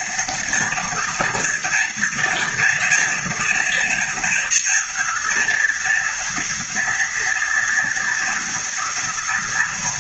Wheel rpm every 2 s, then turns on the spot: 230, 230, 240, 230, 230.
none